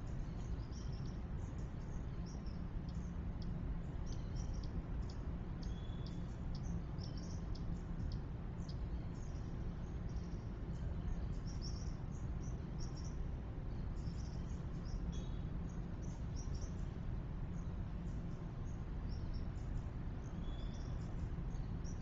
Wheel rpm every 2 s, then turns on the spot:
0, 0, 0, 0, 0, 0, 0, 0, 0, 0, 0.
none